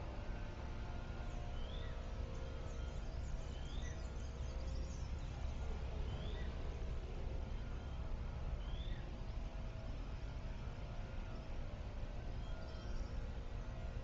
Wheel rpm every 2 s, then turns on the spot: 0, 0, 0, 0, 0, 0, 0.
none